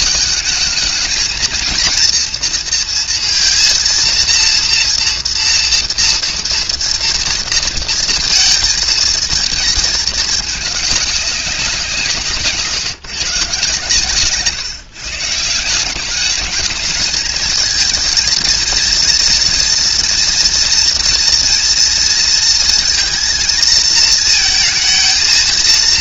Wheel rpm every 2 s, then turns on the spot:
220, 230, 230, 230, 230, 210, 150, 140, 210, 230, 230, 230, 230.
none